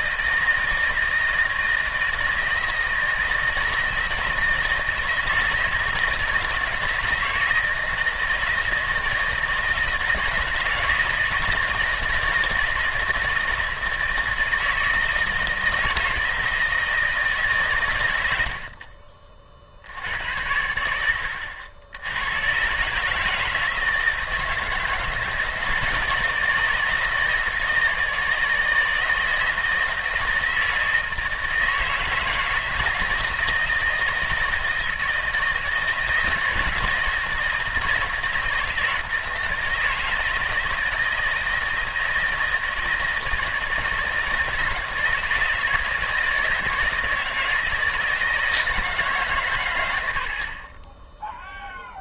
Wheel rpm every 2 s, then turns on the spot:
160, 160, 160, 160, 160, 160, 160, 160, 160, 60, 80, 120, 160, 160, 160, 160, 160, 160, 160, 160, 160, 160, 160, 170, 160, 30.
none